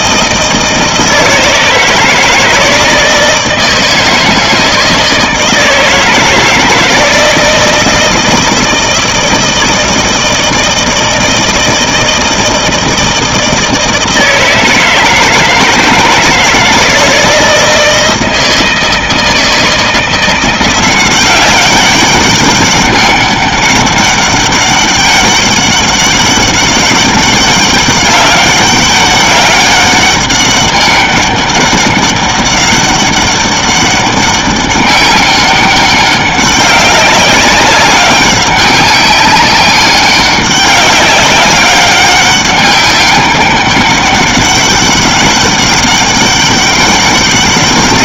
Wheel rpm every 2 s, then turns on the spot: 170, 160, 160, 160, 160, 160, 160, 160, 160, 160, 180, 200, 200, 200, 200, 200, 200, 200, 200, 190, 190, 200, 200, 200.
none